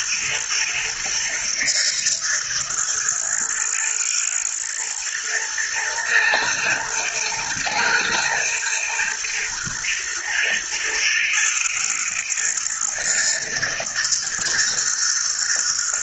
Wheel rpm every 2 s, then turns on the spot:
120, 110, 120, 120, 120, 110, 110, 120.
none